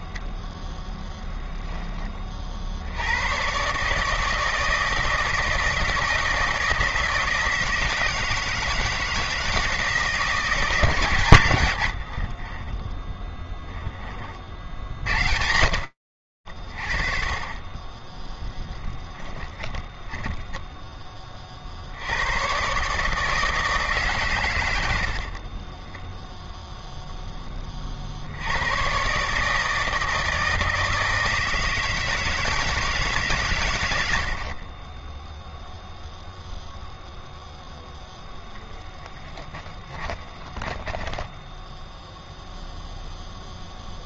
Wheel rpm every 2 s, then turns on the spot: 10, 80, 160, 160, 160, 160, 20, 70, 80, 10, 10, 120, 100, 0, 120, 160, 150, 20, 0, 10, 10, 0.
0-2 12-14 20-22 34-36 38-42